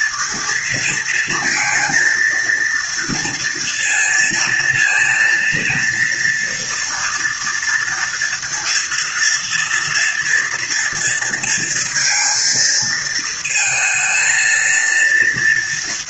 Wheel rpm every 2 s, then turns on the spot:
230, 230, 230, 230, 230, 230, 230, 230.
none